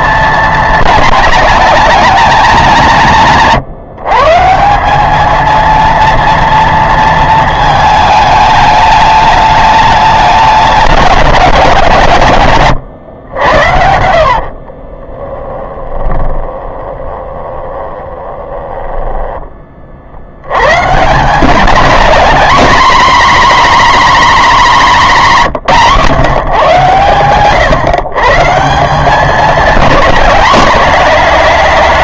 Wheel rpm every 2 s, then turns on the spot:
220, 190, 190, 230, 210, 200, 110, 50, 20, 20, 120, 250, 240, 130, 170, 210.
14-20